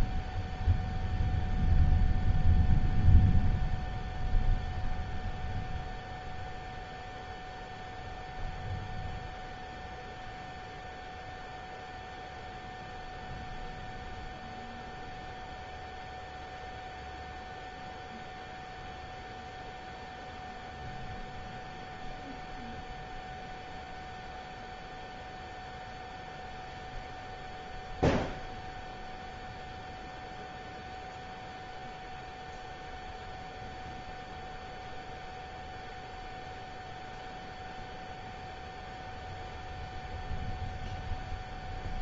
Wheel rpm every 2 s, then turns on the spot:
0, 0, 0, 0, 0, 0, 0, 0, 0, 0, 0, 0, 0, 0, 0, 0, 0, 0, 0, 0, 0.
none